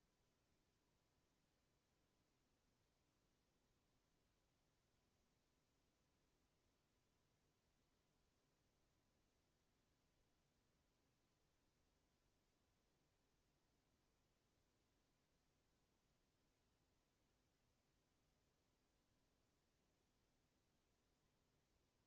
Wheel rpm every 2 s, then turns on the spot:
0, 0, 0, 0, 0, 0, 0, 0, 0, 0, 0.
none